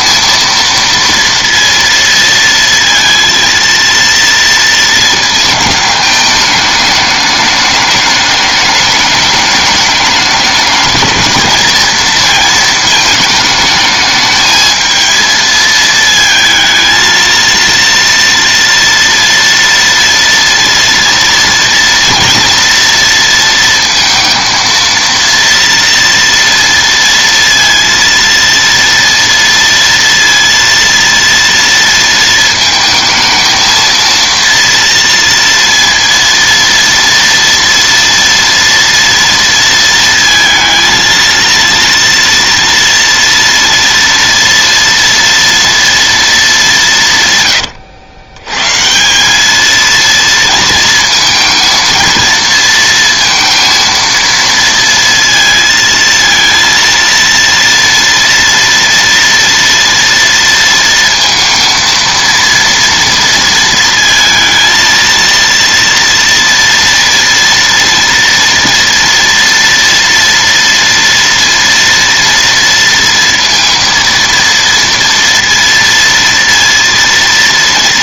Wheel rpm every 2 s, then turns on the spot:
230, 230, 220, 210, 210, 220, 230, 220, 220, 230, 230, 230, 230, 230, 230, 230, 220, 230, 230, 230, 230, 230, 230, 180, 170, 230, 230, 230, 230, 230, 230, 230, 230, 230, 230, 230, 230, 230, 230.
none